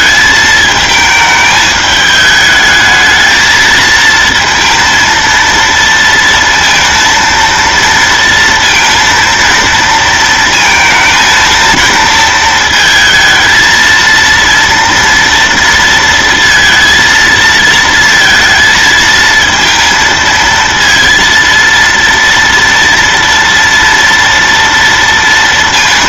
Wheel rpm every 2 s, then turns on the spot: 220, 220, 230, 230, 230, 230, 230, 230, 230, 230, 230, 230, 230.
none